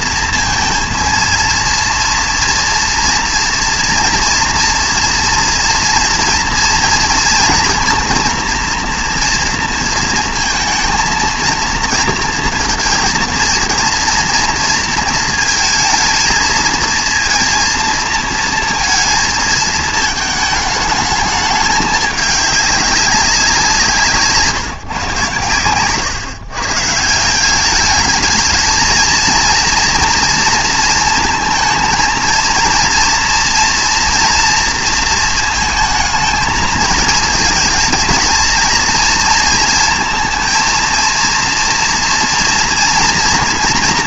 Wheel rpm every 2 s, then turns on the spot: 230, 230, 240, 230, 230, 230, 220, 230, 230, 230, 220, 200, 160, 130, 220, 230, 230, 230, 220, 230, 230, 240.
none